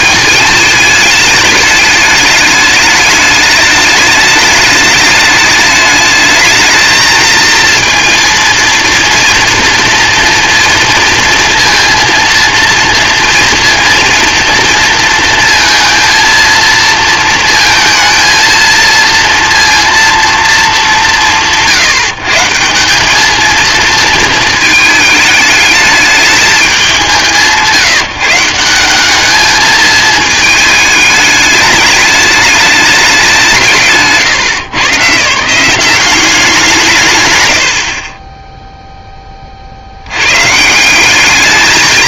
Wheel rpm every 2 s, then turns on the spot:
220, 210, 210, 220, 230, 230, 230, 230, 230, 230, 210, 180, 220, 190, 180, 220, 210, 130, 170, 0, 140.
none